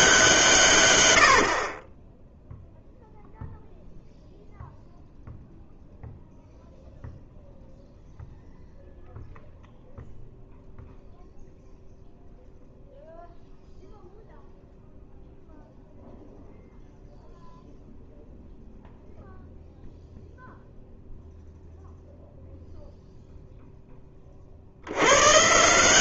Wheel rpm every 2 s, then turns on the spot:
140, 0, 0, 0, 0, 0, 0, 0, 0, 0, 0, 0, 70.
none